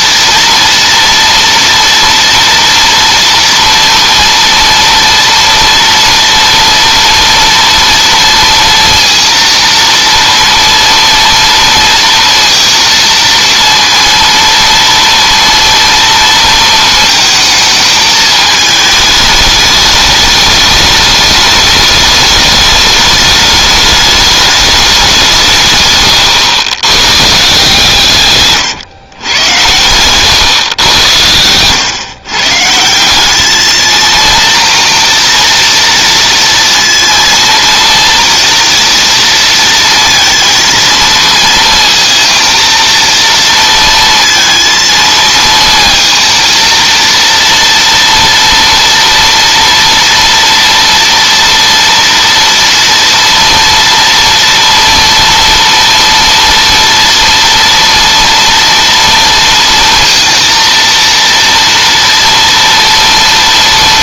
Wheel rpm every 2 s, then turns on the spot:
230, 230, 230, 230, 230, 230, 230, 230, 230, 220, 210, 210, 210, 130, 150, 110, 120, 230, 230, 230, 230, 230, 230, 230, 230, 230, 230, 230, 230, 230, 230, 230.
none